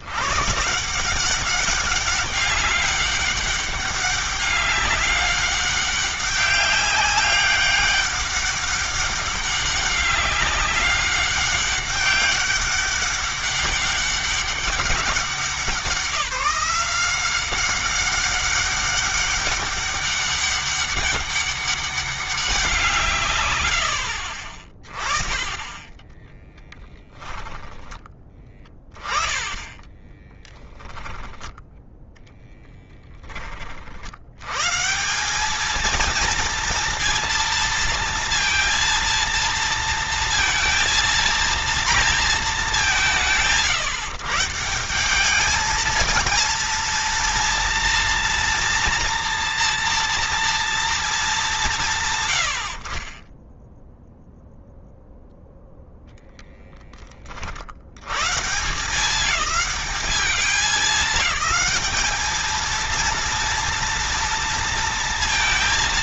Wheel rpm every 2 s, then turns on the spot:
170, 200, 200, 200, 190, 190, 200, 190, 180, 200, 200, 150, 30, 0, 20, 10, 10, 150, 230, 230, 230, 190, 170, 230, 230, 220, 40, 0, 20, 150, 200, 230, 230.
28-30